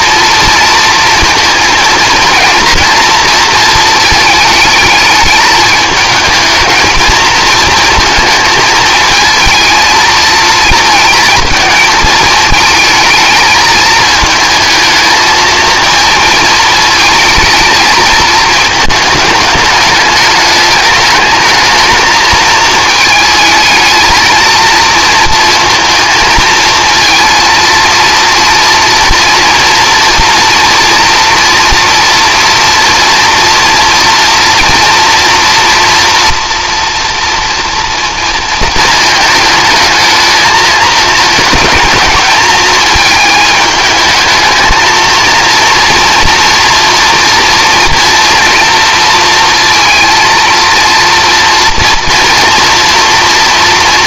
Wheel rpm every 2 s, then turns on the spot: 230, 230, 210, 210, 220, 230, 220, 220, 220, 220, 210, 220, 230, 230, 230, 230, 230, 230, 230, 220, 220, 220, 220, 230, 230, 230, 230.
none